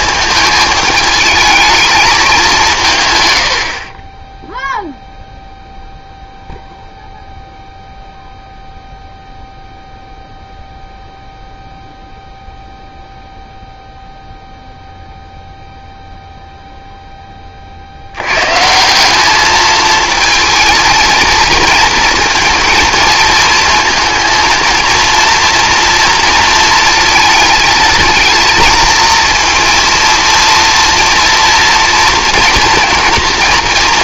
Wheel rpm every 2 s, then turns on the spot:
220, 170, 0, 0, 0, 0, 0, 0, 0, 150, 220, 230, 220, 230, 230, 230, 230.
none